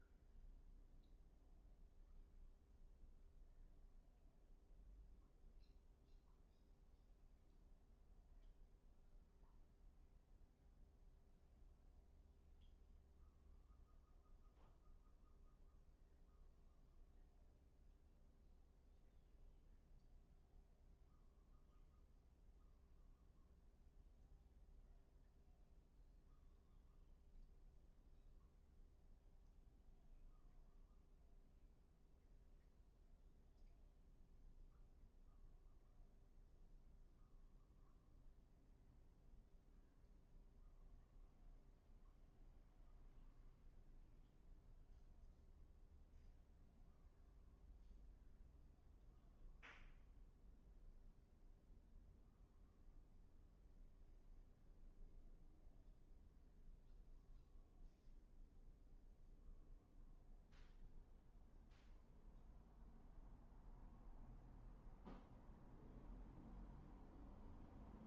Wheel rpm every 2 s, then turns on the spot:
0, 0, 0, 0, 0, 0, 0, 0, 0, 0, 0, 0, 0, 0, 0, 0, 0, 0, 0, 0, 0, 0, 0, 0, 0, 0, 0, 0, 0, 0, 0, 0, 0, 0.
none